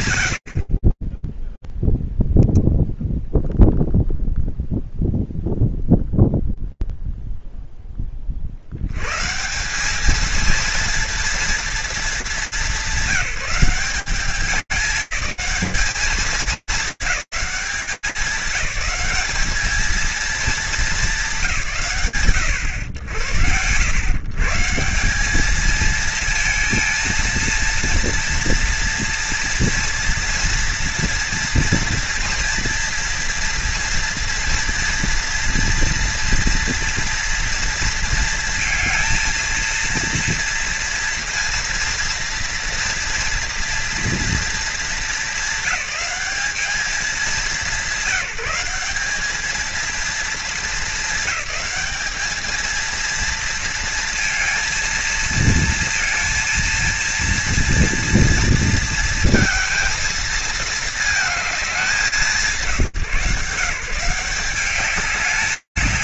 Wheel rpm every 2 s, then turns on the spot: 50, 0, 0, 0, 60, 220, 200, 200, 220, 210, 220, 120, 140, 230, 230, 230, 230, 230, 240, 230, 230, 230, 220, 210, 200, 220, 230, 230, 220, 220, 210, 150, 200.
none